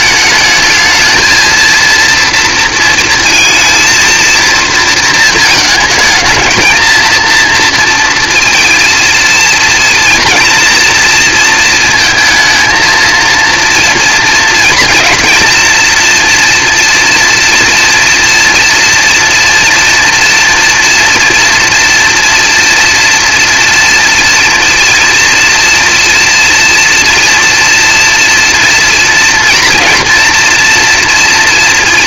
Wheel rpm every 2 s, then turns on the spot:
220, 230, 230, 220, 230, 240, 230, 230, 230, 230, 230, 230, 230, 230, 240, 240.
none